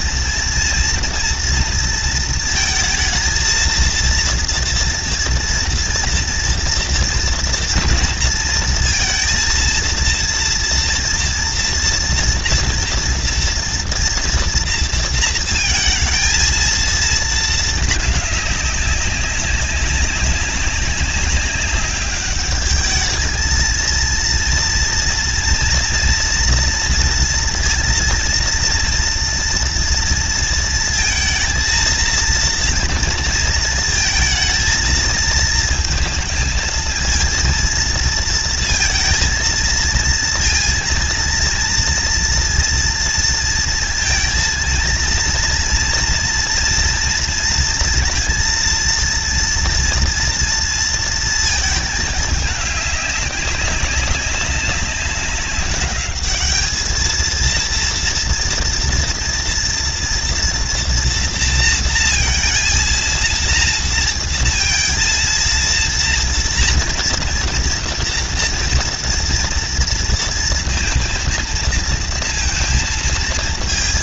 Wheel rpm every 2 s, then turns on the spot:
230, 230, 230, 230, 230, 230, 230, 230, 220, 210, 190, 200, 230, 240, 240, 230, 230, 220, 220, 230, 230, 230, 230, 230, 230, 230, 220, 200, 210, 230, 230, 230, 230, 230, 230, 230, 230.
none